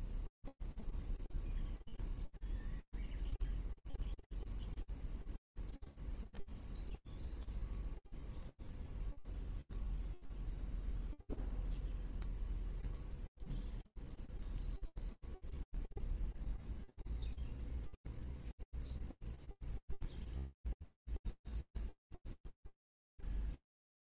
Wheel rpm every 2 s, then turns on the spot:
0, 0, 0, 0, 0, 0, 0, 0, 0, 0, 0, 0.
none